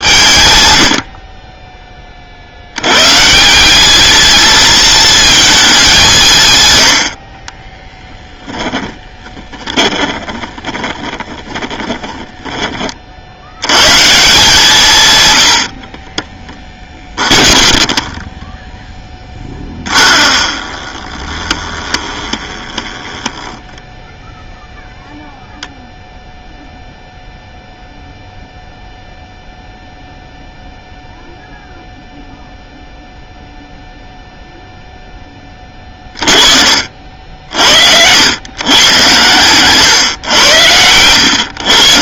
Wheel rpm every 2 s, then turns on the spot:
130, 70, 220, 120, 10, 30, 20, 170, 20, 10, 20, 20, 0, 0, 0, 0, 0, 0, 50, 110, 110.
8-12 16-24 36-38